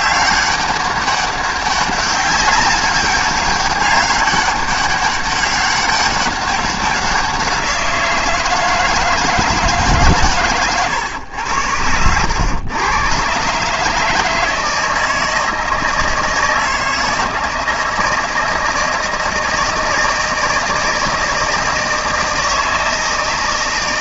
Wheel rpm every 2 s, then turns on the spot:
190, 200, 200, 190, 160, 120, 110, 160, 160, 170, 160, 160.
none